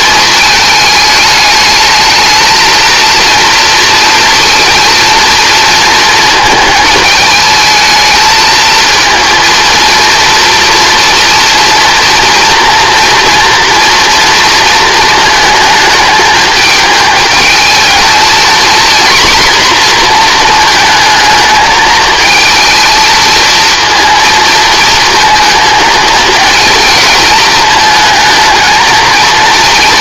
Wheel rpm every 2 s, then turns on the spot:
220, 220, 230, 220, 230, 230, 230, 230, 220, 240, 230, 220, 230, 230, 220.
none